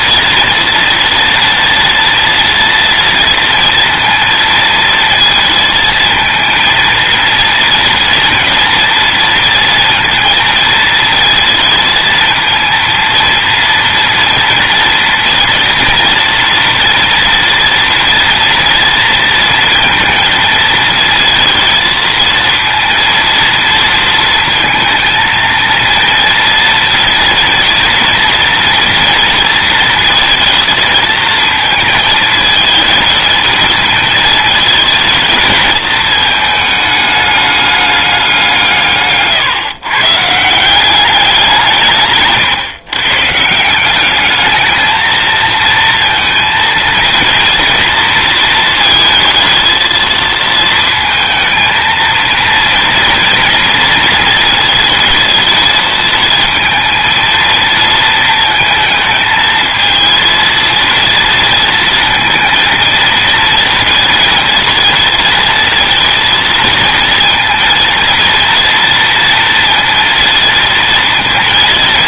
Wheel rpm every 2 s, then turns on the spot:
240, 230, 230, 230, 230, 230, 230, 230, 230, 230, 230, 230, 220, 230, 230, 220, 220, 220, 210, 160, 180, 130, 220, 230, 230, 230, 230, 220, 230, 220, 230, 230, 230, 230, 230, 230.
none